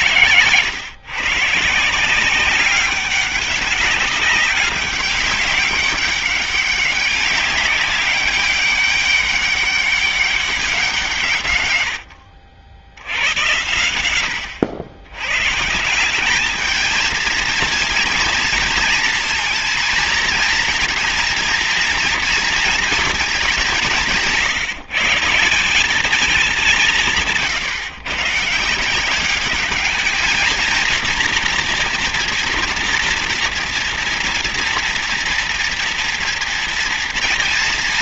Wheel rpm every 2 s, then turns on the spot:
120, 180, 190, 200, 200, 190, 70, 100, 200, 230, 230, 230, 170, 200, 150, 220, 230, 230, 230.
none